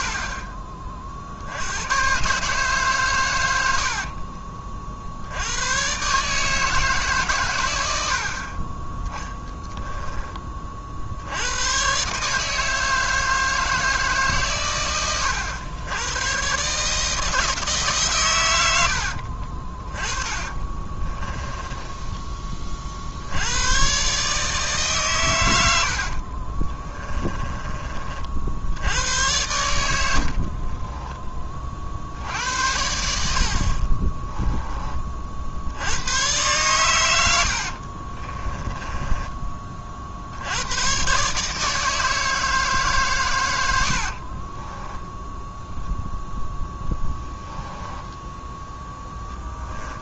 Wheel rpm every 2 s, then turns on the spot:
40, 140, 40, 160, 30, 40, 160, 120, 140, 80, 30, 40, 150, 30, 90, 30, 80, 20, 110, 20, 110, 150, 20, 0, 10.
20-22 26-28 30-32 38-40 44-46